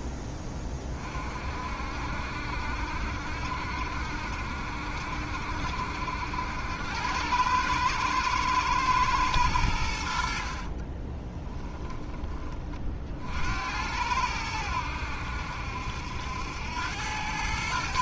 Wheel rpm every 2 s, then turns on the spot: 30, 70, 60, 90, 110, 30, 40, 90, 90.
10-12